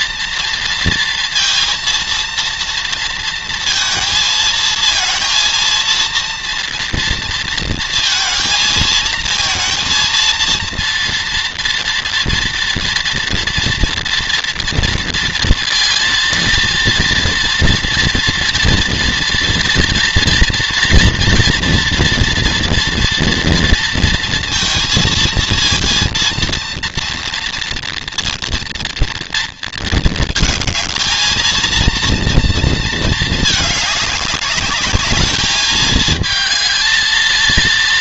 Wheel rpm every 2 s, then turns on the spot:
230, 230, 230, 230, 220, 230, 230, 230, 230, 230, 230, 230, 230, 230, 230, 220, 230, 210, 220.
none